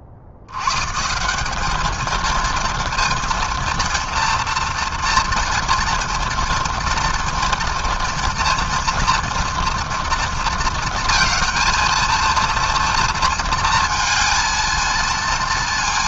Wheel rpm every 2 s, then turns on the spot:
70, 230, 230, 230, 240, 230, 230, 230.
none